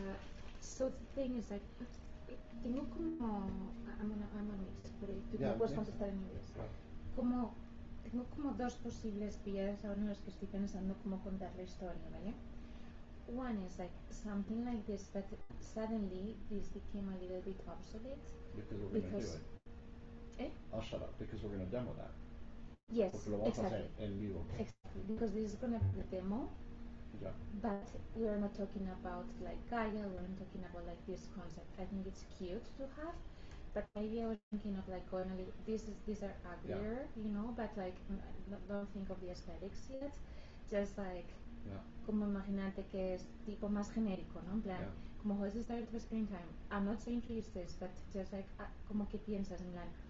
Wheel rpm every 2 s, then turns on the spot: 0, 0, 0, 0, 0, 0, 0, 0, 0, 0, 0, 0, 0, 0, 0, 0, 0, 0, 0, 0, 0, 0, 0, 0, 0.
none